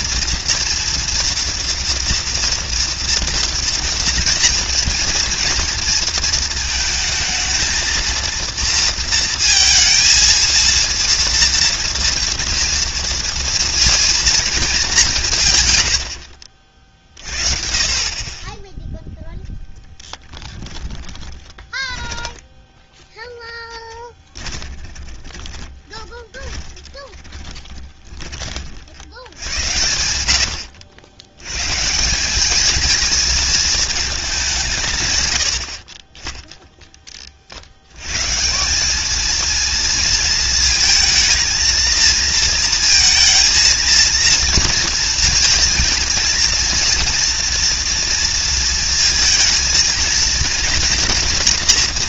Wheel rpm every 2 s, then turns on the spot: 240, 230, 230, 230, 220, 220, 230, 230, 100, 40, 0, 10, 10, 20, 10, 90, 140, 230, 70, 80, 230, 230, 230, 230, 230, 220.
22-30